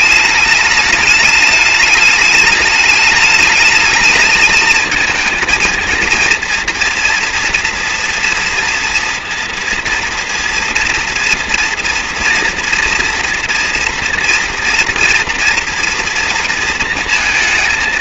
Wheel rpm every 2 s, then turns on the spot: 210, 210, 220, 230, 230, 230, 240, 230, 230.
none